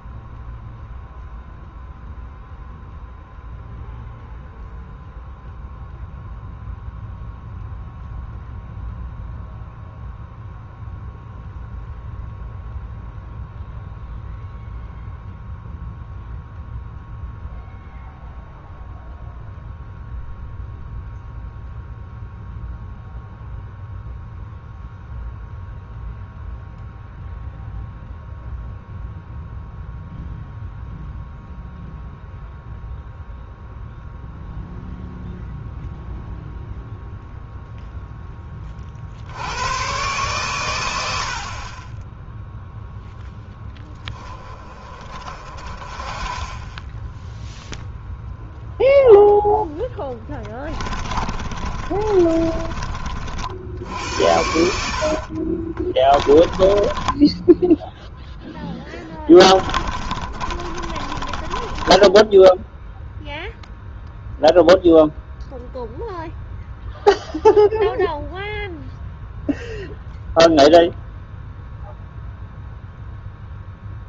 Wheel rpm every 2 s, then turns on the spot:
0, 0, 0, 0, 0, 0, 0, 0, 0, 0, 0, 0, 0, 0, 0, 0, 0, 0, 0, 40, 100, 0, 20, 10, 0, 20, 30, 60, 20, 10, 30, 0, 0, 0, 0, 0, 0.
40-42 50-52 54-62